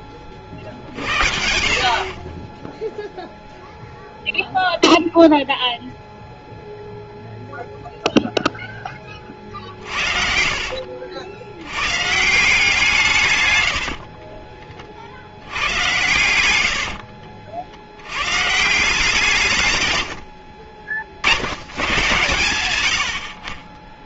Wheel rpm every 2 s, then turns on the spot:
50, 0, 0, 0, 0, 60, 160, 30, 100, 160, 60, 100.
10-12 16-18 20-22